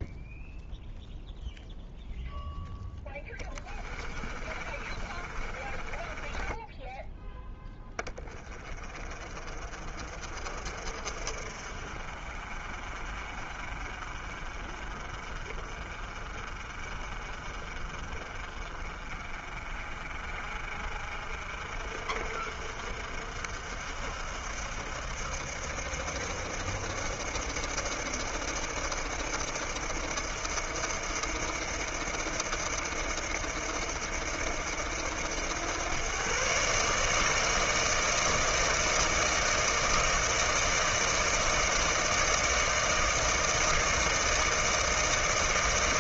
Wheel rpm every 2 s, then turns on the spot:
0, 0, 20, 20, 30, 40, 50, 50, 40, 40, 50, 60, 60, 70, 70, 80, 80, 80, 120, 160, 160, 160, 160.
4-8